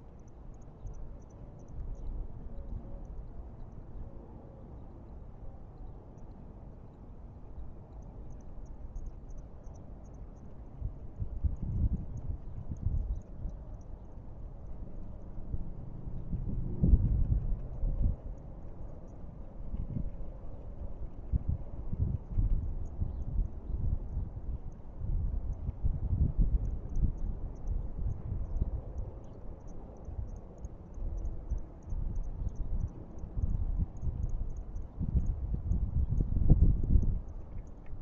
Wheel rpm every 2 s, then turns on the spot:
0, 0, 0, 0, 0, 0, 0, 0, 0, 0, 0, 0, 0, 0, 0, 0, 0, 0, 0.
none